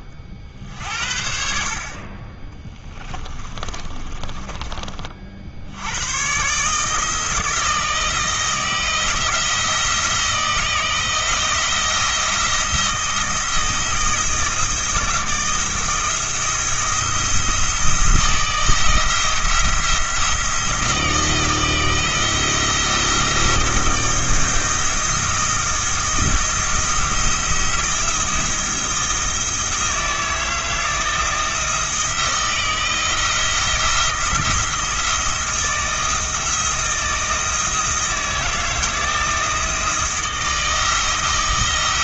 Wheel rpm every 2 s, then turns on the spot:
60, 20, 40, 160, 160, 170, 170, 160, 170, 160, 170, 170, 160, 170, 170, 160, 170, 160, 160, 170, 160.
2-4